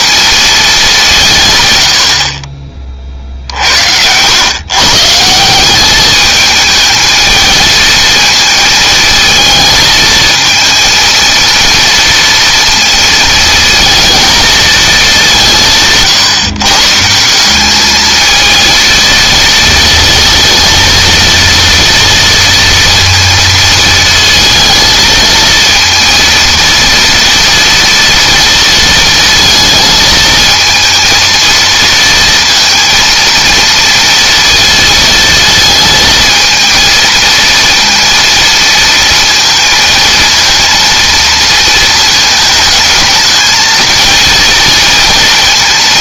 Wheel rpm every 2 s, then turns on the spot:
210, 30, 140, 220, 220, 230, 230, 220, 150, 230, 230, 230, 230, 230, 230, 220, 230, 220, 230, 230, 230, 220, 230.
none